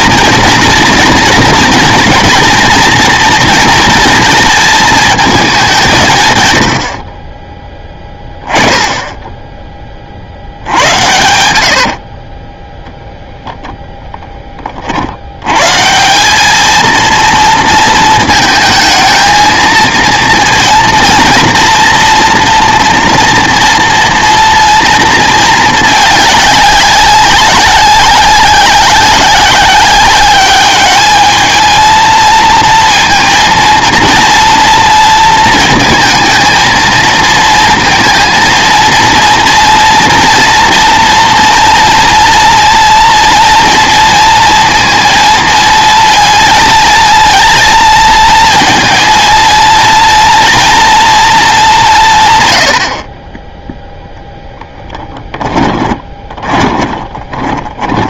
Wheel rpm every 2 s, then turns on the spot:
230, 240, 220, 80, 10, 90, 10, 30, 220, 220, 230, 240, 230, 200, 190, 210, 230, 230, 230, 230, 240, 240, 230, 230, 230, 230, 100, 10, 20.
12-14 54-58